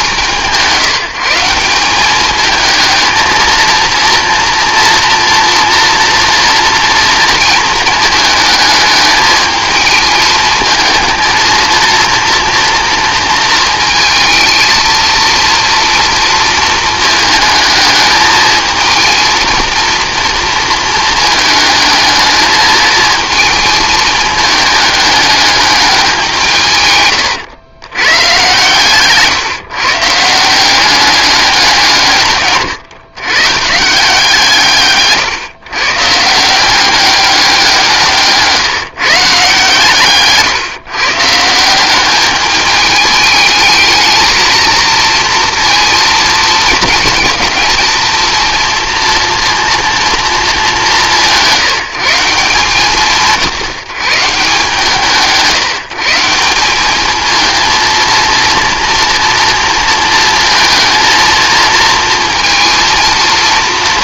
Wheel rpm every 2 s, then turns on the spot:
170, 220, 230, 230, 220, 230, 230, 230, 220, 220, 230, 220, 210, 140, 130, 190, 130, 150, 190, 160, 140, 210, 230, 220, 230, 200, 170, 160, 190, 230, 230, 230.
28-30